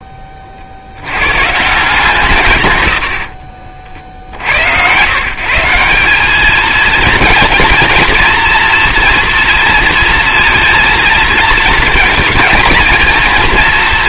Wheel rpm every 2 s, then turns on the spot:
60, 100, 90, 220, 230, 230, 230.
none